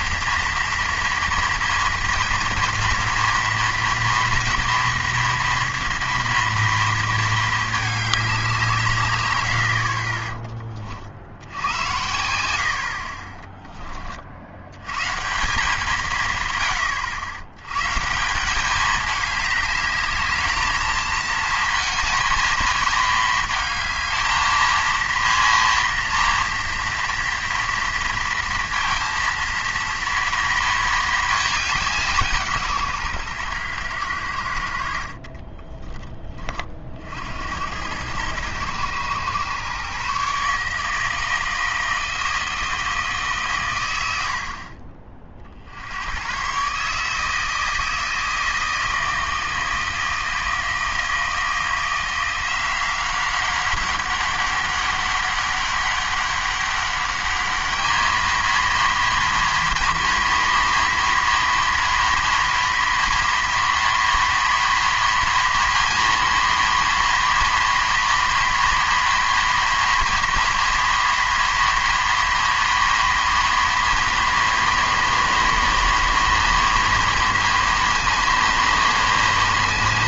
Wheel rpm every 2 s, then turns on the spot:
230, 230, 230, 230, 160, 30, 60, 90, 110, 200, 220, 220, 220, 230, 230, 230, 150, 70, 40, 110, 150, 160, 50, 140, 160, 160, 180, 200, 200, 230, 230, 230, 230, 230, 230, 230, 230, 230, 230, 230.
none